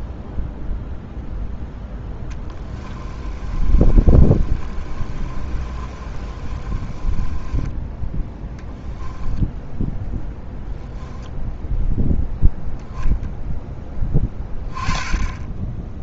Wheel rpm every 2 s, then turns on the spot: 0, 20, 30, 20, 10, 10, 0, 10.
2-8